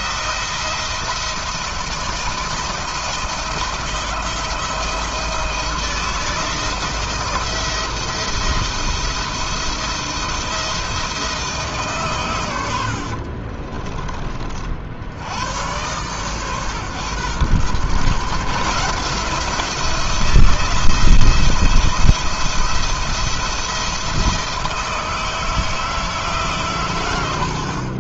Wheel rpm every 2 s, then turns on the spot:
170, 170, 160, 170, 170, 170, 60, 80, 130, 160, 170, 170, 160, 100.
12-14